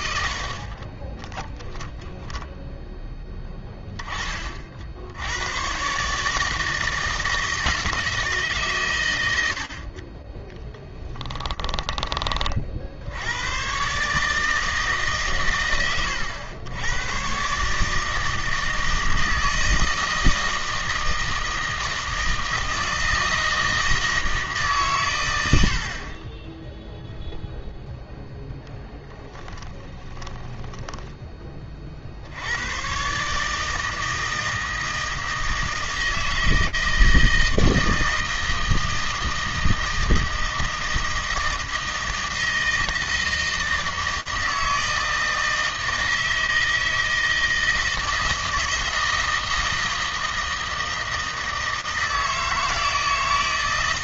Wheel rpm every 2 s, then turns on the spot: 40, 10, 70, 160, 130, 10, 50, 150, 100, 160, 160, 160, 140, 0, 10, 10, 110, 160, 160, 160, 160, 160, 160, 160, 160, 160, 160.
0-2 28-32